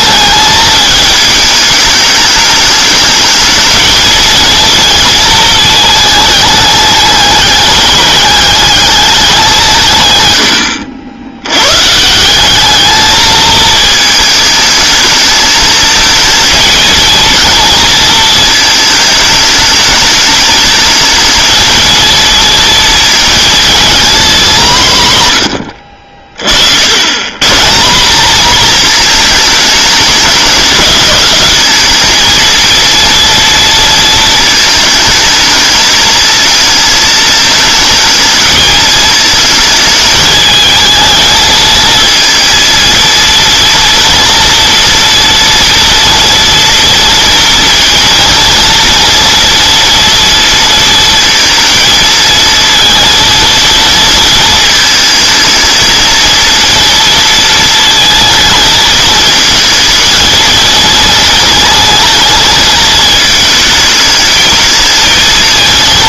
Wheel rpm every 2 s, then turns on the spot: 220, 210, 230, 210, 210, 80, 210, 220, 230, 220, 220, 220, 170, 80, 230, 210, 230, 220, 220, 220, 220, 230, 240, 230, 230, 230, 230, 220, 230, 220, 230, 220, 220.
none